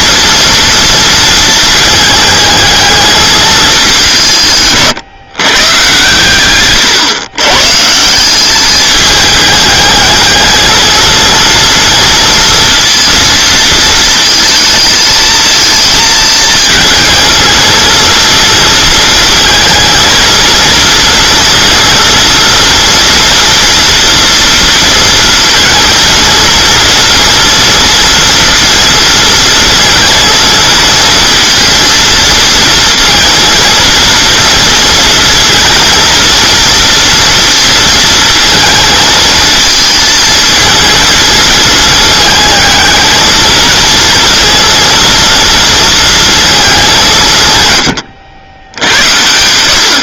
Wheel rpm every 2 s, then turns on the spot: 240, 220, 160, 130, 210, 220, 230, 220, 220, 230, 230, 230, 230, 230, 230, 230, 230, 230, 230, 230, 220, 220, 230, 210, 80.
4-8